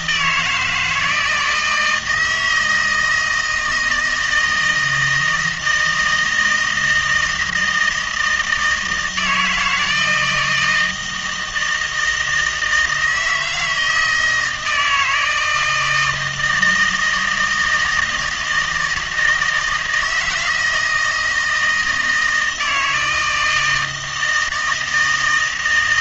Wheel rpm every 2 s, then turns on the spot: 160, 160, 160, 160, 160, 160, 160, 160, 160, 160, 160, 160, 160.
none